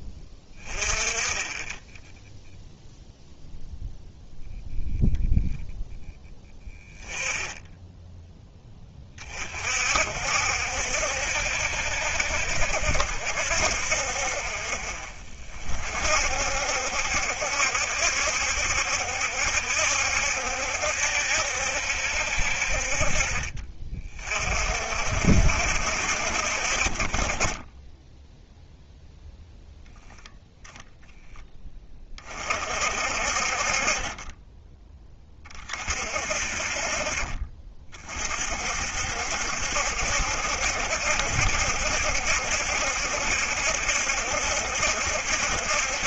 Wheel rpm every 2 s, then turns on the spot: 20, 0, 0, 10, 40, 70, 60, 50, 70, 70, 70, 40, 60, 20, 0, 20, 40, 50, 40, 70, 70, 70, 70.
none